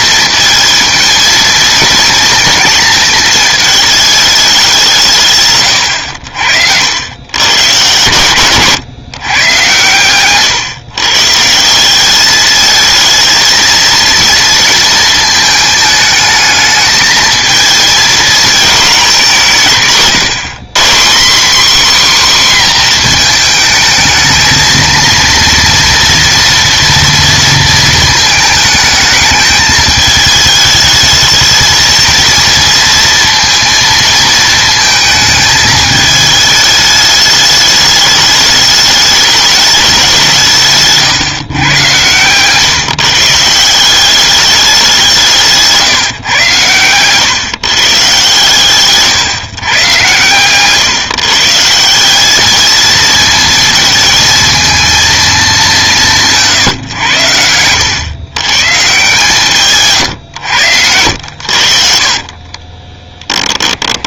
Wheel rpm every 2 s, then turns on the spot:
220, 230, 200, 70, 130, 140, 220, 230, 220, 220, 170, 250, 220, 230, 220, 210, 230, 230, 220, 210, 150, 140, 200, 120, 130, 130, 220, 230, 150, 130, 90, 30.
50-52 62-64